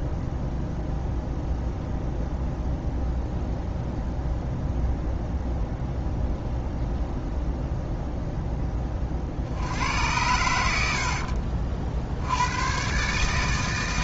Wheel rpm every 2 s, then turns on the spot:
0, 0, 0, 0, 20, 80, 130.
none